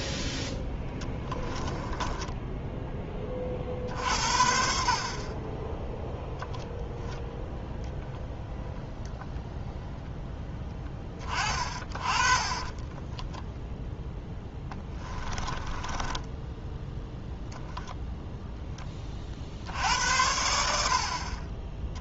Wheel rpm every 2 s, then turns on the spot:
10, 10, 50, 0, 0, 10, 20, 10, 10, 10, 70.
0-2 12-16